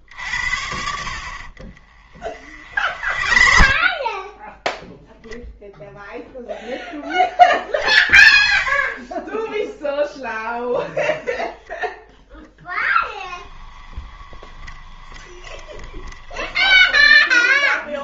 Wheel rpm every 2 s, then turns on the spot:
70, 50, 0, 0, 10, 0, 10, 20, 10.
2-4 12-18